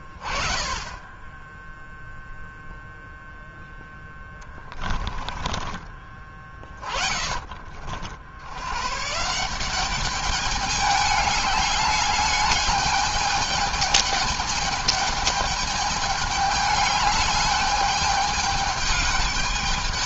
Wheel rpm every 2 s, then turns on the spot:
20, 0, 20, 30, 110, 210, 210, 210, 210, 210.
4-8